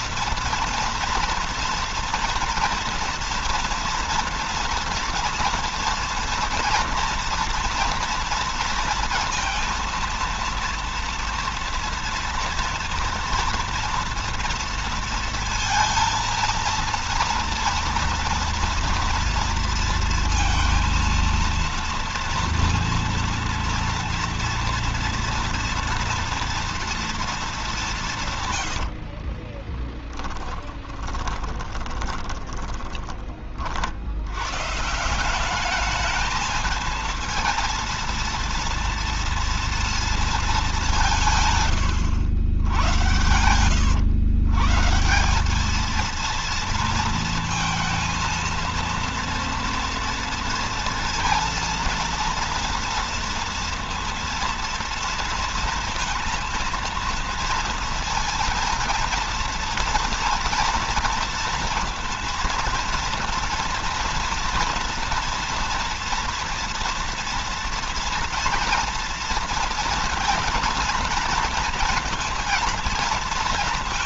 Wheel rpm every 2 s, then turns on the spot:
230, 230, 230, 230, 230, 230, 230, 230, 230, 230, 230, 230, 230, 230, 90, 20, 20, 140, 220, 230, 200, 100, 150, 230, 230, 230, 230, 230, 230, 230, 230, 230, 240, 230, 230, 230, 230.
28-34